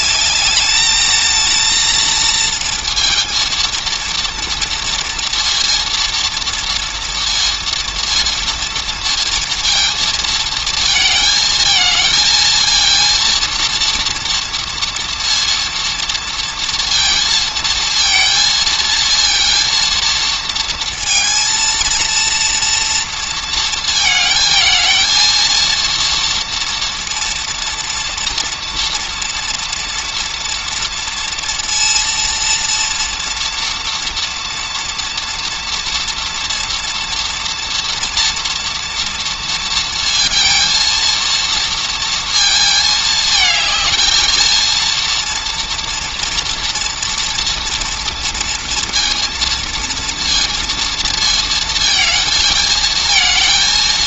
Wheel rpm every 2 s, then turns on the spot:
210, 230, 230, 230, 230, 220, 220, 230, 230, 230, 230, 230, 220, 230, 240, 230, 230, 230, 230, 240, 230, 220, 230, 230, 230, 230, 220.
none